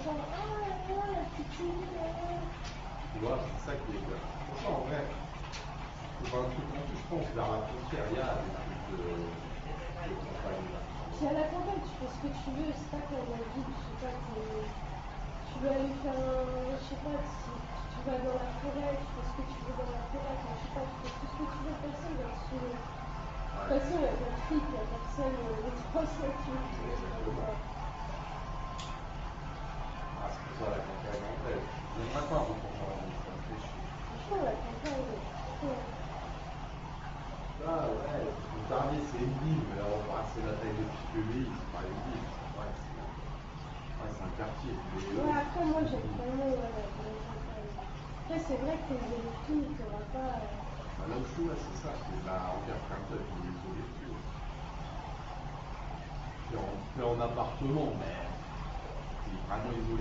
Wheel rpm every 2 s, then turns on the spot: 0, 0, 0, 0, 0, 0, 0, 0, 0, 0, 0, 0, 0, 0, 0, 0, 0, 0, 0, 0, 0, 0, 0, 0, 0, 0, 0, 0, 0, 0.
none